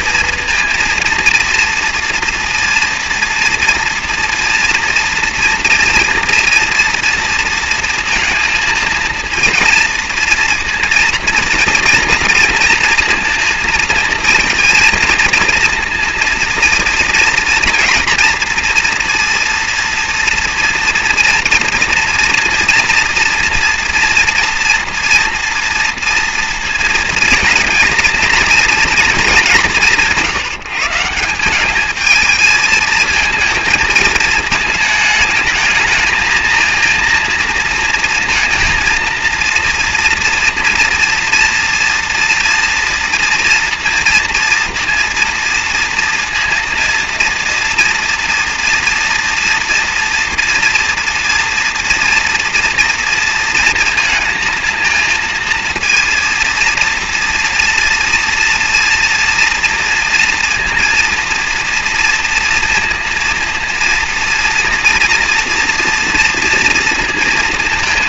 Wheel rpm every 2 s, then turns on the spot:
230, 240, 230, 230, 230, 230, 230, 230, 230, 240, 230, 230, 240, 230, 230, 160, 230, 220, 230, 230, 230, 230, 230, 230, 230, 230, 230, 230, 230, 230, 230, 230, 230, 230.
none